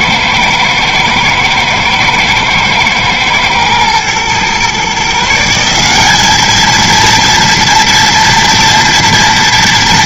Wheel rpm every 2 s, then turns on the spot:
120, 120, 130, 230, 230.
none